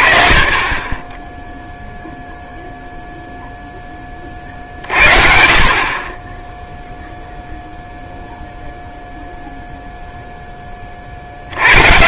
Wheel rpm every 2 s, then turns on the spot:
50, 0, 50, 0, 0, 0.
none